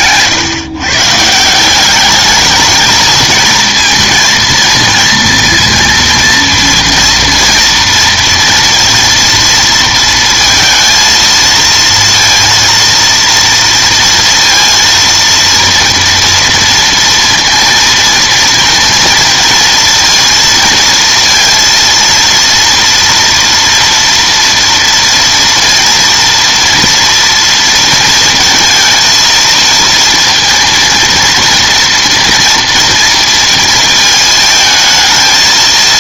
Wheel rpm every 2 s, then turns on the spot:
140, 220, 230, 230, 230, 230, 230, 230, 230, 230, 230, 230, 230, 230, 230, 230, 230, 220.
none